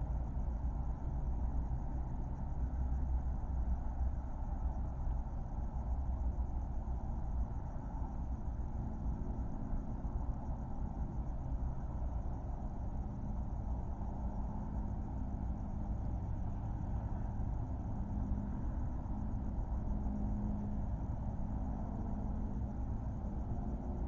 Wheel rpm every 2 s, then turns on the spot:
0, 0, 0, 0, 0, 0, 0, 0, 0, 0, 0, 0.
none